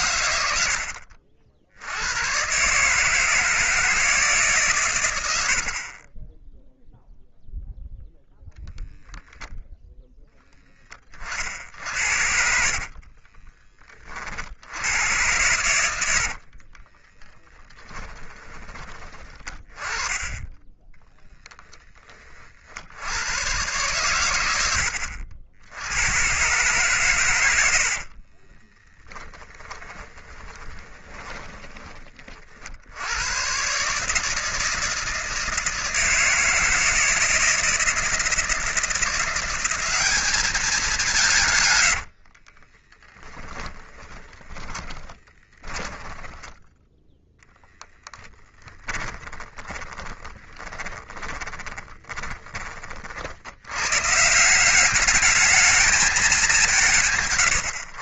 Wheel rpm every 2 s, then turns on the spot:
70, 140, 130, 0, 0, 20, 50, 80, 30, 20, 10, 70, 80, 130, 20, 20, 70, 160, 160, 170, 200, 20, 20, 0, 10, 20, 40, 200, 170.
12-14 16-18 28-32 42-46 48-52